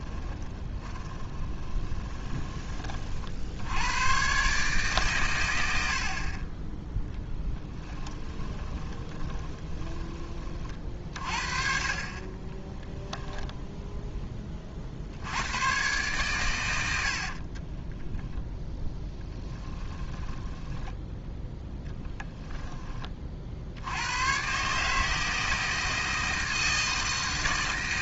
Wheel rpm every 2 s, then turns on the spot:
20, 30, 140, 10, 10, 40, 10, 40, 90, 0, 10, 10, 140, 160.
0-2 8-10 12-14 20-22